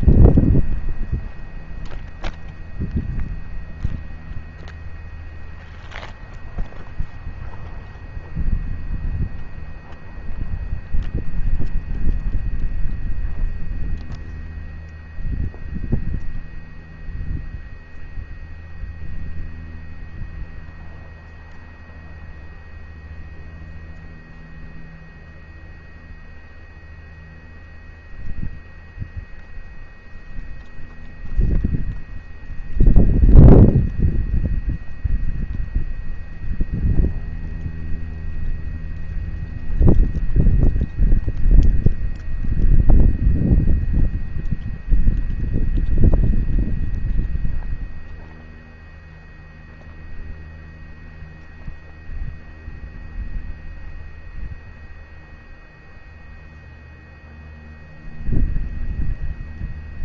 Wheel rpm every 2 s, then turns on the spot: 0, 0, 0, 0, 0, 0, 0, 0, 0, 0, 0, 0, 0, 0, 0, 0, 0, 0, 0, 0, 0, 0, 0, 0, 0, 0, 0, 0, 0, 0.
none